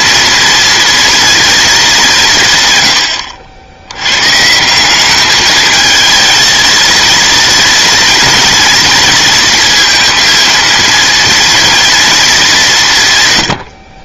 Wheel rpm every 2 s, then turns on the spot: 230, 120, 180, 230, 230, 230, 180.
none